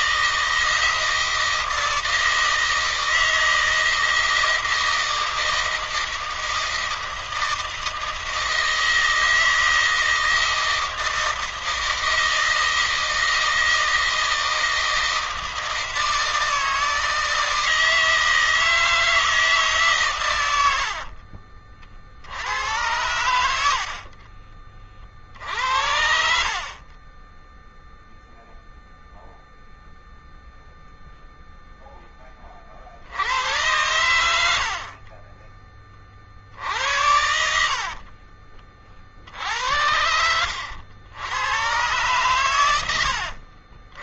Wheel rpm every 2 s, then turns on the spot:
160, 160, 160, 160, 160, 160, 160, 160, 160, 160, 100, 90, 50, 50, 0, 0, 20, 80, 60, 50, 90, 110.
20-22 24-26